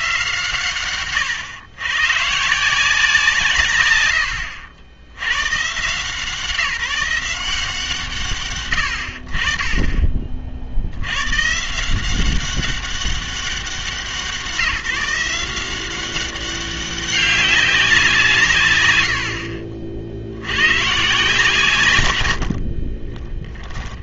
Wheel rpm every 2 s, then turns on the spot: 140, 160, 80, 170, 110, 60, 190, 170, 190, 90, 110, 50.
22-24